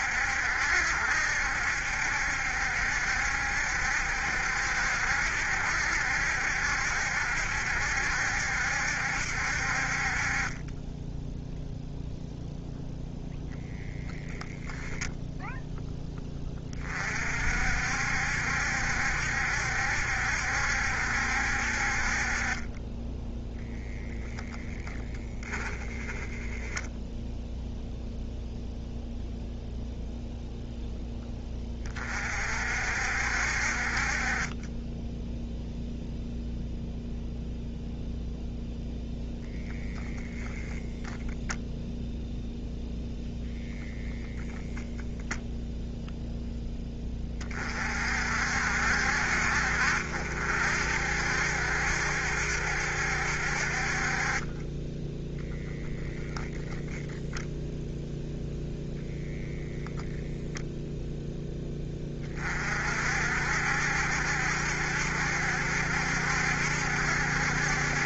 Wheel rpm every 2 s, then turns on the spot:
70, 70, 70, 70, 70, 30, 0, 0, 20, 70, 70, 30, 0, 0, 0, 0, 60, 20, 0, 0, 0, 0, 0, 0, 60, 60, 70, 20, 0, 0, 0, 40, 70, 70.
none